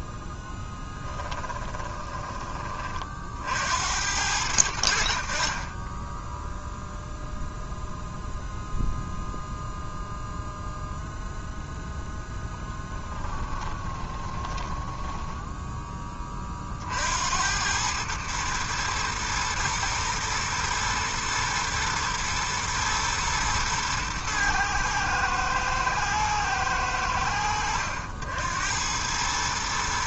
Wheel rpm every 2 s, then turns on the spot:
10, 30, 90, 0, 0, 0, 20, 10, 40, 110, 120, 110, 110, 90, 80.
0-2 12-16